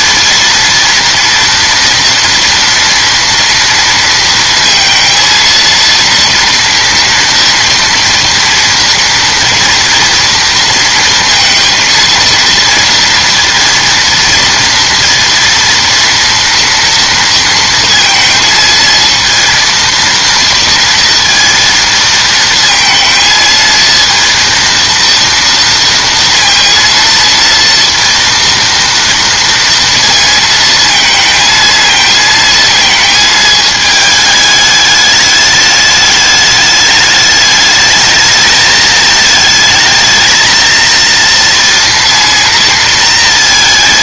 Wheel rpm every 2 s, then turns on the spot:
230, 230, 230, 240, 230, 230, 230, 230, 230, 230, 230, 230, 230, 230, 230, 220, 220, 210, 210, 220, 230, 230.
none